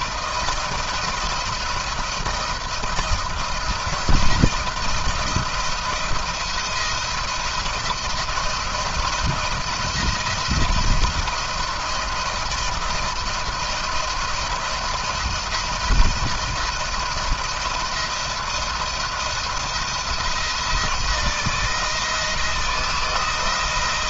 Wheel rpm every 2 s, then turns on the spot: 170, 170, 170, 170, 170, 170, 170, 170, 170, 170, 170, 160.
none